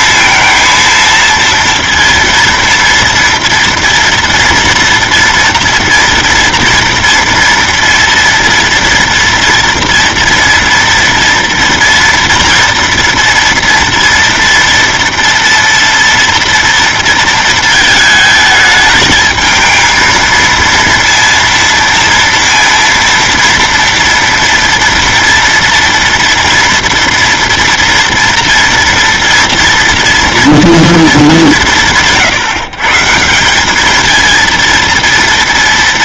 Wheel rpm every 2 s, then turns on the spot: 230, 230, 230, 230, 230, 230, 230, 230, 230, 220, 230, 230, 230, 230, 230, 230, 160, 230.
none